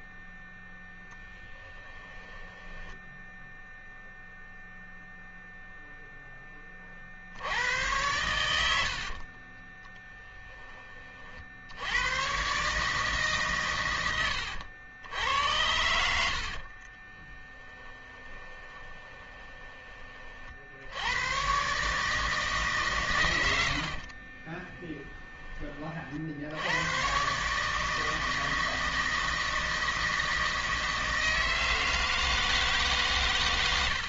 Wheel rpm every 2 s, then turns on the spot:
0, 10, 0, 20, 80, 20, 140, 90, 50, 20, 60, 150, 30, 90, 160, 160, 160.
2-4 16-20 24-26